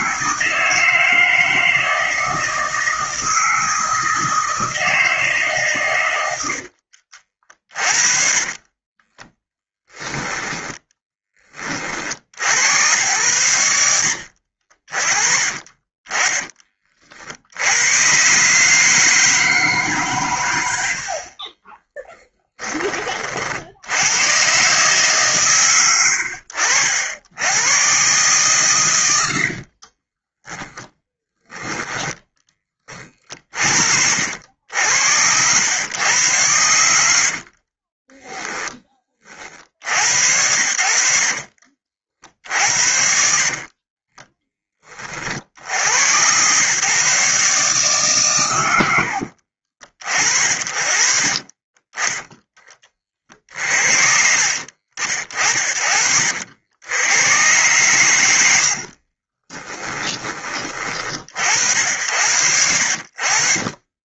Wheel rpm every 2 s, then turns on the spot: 160, 160, 150, 40, 20, 20, 100, 40, 60, 160, 50, 40, 150, 80, 100, 10, 30, 90, 60, 40, 70, 50, 40, 140, 70, 40, 30, 50, 100, 40, 50, 50.
6-10 28-32 36-38 42-44 48-52 58-60